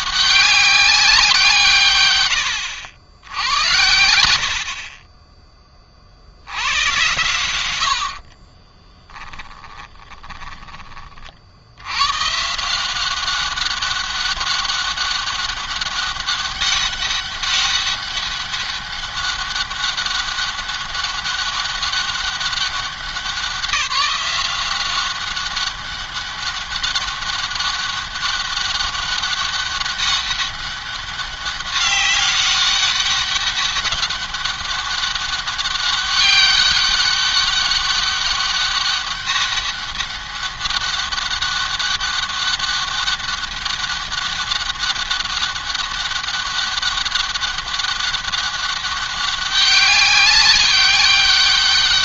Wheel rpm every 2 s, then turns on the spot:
190, 90, 50, 100, 30, 20, 170, 200, 200, 200, 200, 190, 190, 200, 200, 200, 200, 200, 200, 200, 200, 200, 200, 200, 200, 200.
8-10